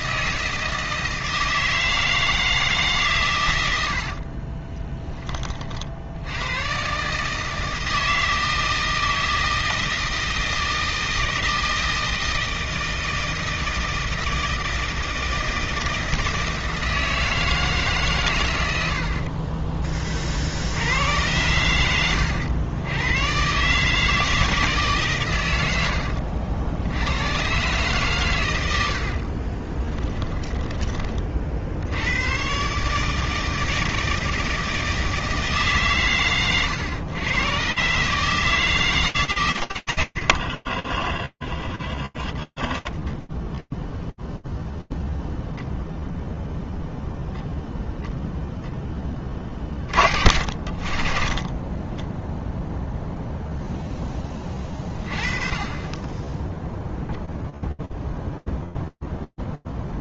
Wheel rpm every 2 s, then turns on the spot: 160, 140, 10, 140, 160, 160, 160, 160, 160, 70, 90, 110, 140, 100, 50, 40, 150, 160, 110, 150, 20, 0, 0, 0, 70, 10, 10, 10, 0, 0.
4-6 28-30 40-42 50-52